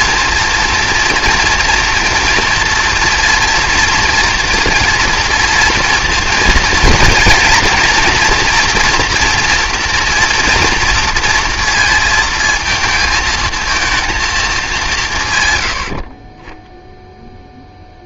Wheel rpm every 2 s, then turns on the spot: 230, 230, 230, 230, 240, 230, 230, 190, 10.
none